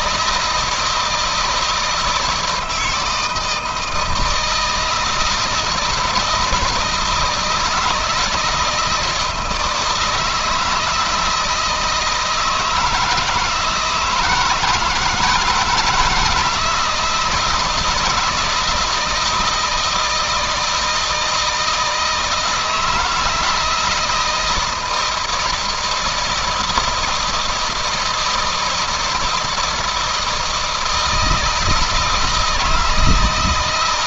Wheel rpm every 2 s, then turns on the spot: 160, 160, 160, 160, 160, 160, 160, 160, 170, 160, 160, 160, 160, 160, 160, 160, 160.
none